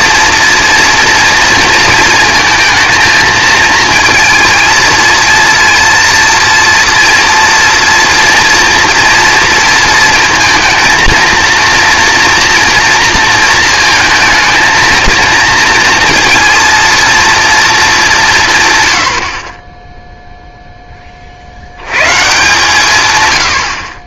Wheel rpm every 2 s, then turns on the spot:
230, 230, 230, 230, 230, 230, 230, 220, 230, 150, 0, 150.
none